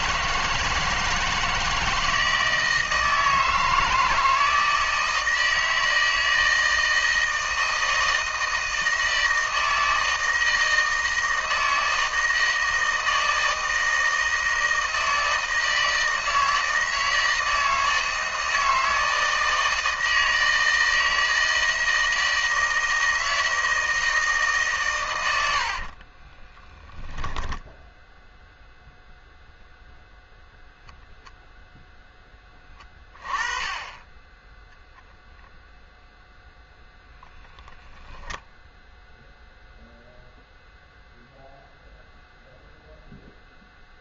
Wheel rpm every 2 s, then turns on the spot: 160, 160, 160, 160, 160, 160, 160, 160, 160, 160, 160, 160, 110, 0, 0, 0, 20, 0, 0, 0, 0, 0.
none